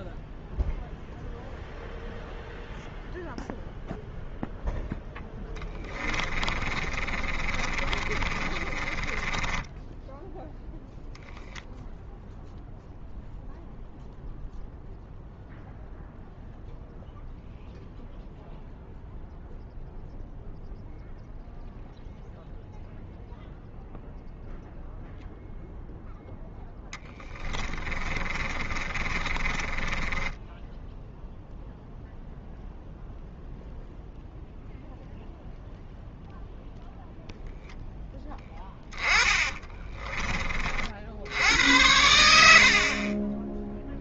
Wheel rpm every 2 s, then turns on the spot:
0, 0, 0, 30, 20, 0, 0, 0, 0, 0, 0, 0, 0, 10, 30, 10, 0, 0, 0, 20, 50, 50.
6-10 26-30 38-40 42-44